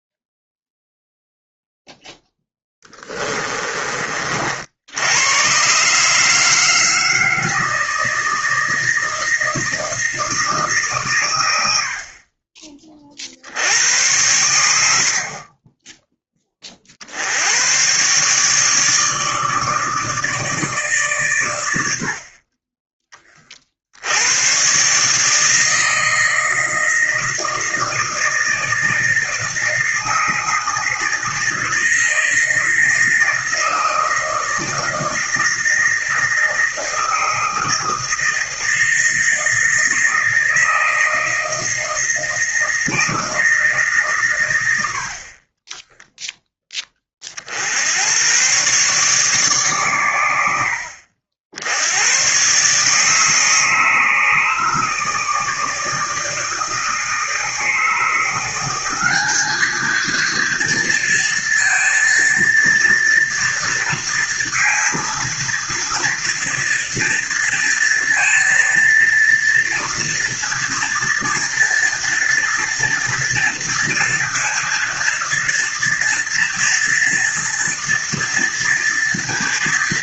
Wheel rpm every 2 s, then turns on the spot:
0, 10, 80, 160, 160, 140, 30, 70, 50, 150, 140, 20, 130, 160, 160, 160, 160, 160, 160, 160, 160, 160, 70, 30, 140, 70, 150, 160, 150, 190, 230, 230, 230, 230, 230, 230, 230, 230, 230, 230.
2-4